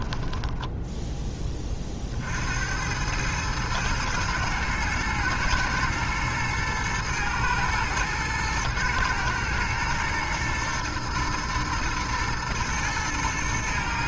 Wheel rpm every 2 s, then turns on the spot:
10, 80, 120, 110, 110, 110, 110.
0-2